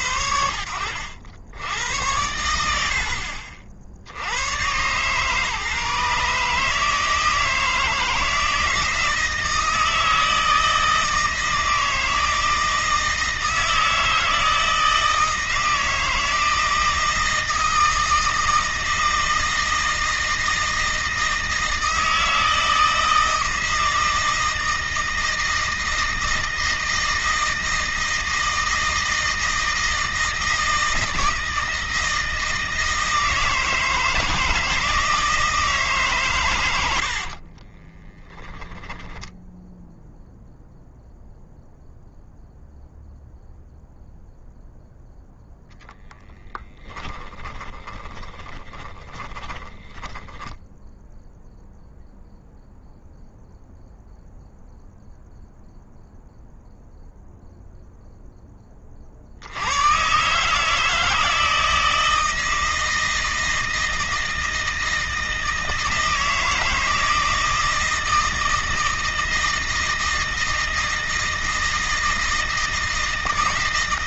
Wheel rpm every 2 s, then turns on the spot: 80, 70, 130, 160, 170, 160, 160, 160, 160, 160, 160, 160, 160, 160, 160, 160, 160, 160, 90, 10, 0, 0, 0, 20, 20, 10, 0, 0, 0, 50, 160, 160, 160, 160, 160, 160, 160.
36-38 46-50